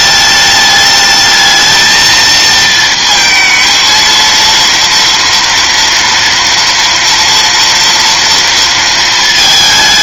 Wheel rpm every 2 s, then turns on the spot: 210, 220, 230, 230, 230.
none